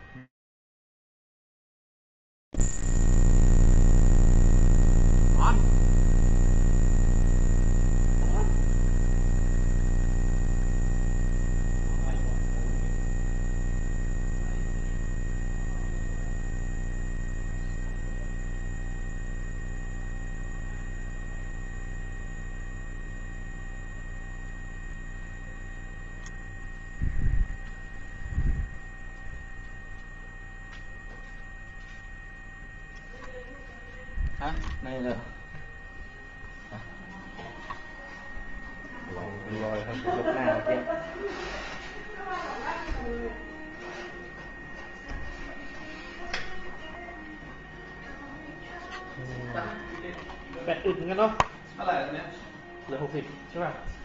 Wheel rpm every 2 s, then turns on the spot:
0, 0, 0, 0, 0, 0, 0, 0, 0, 0, 0, 0, 0, 0, 0, 0, 0, 0, 0, 0, 0, 0, 0, 0, 0, 0, 0.
none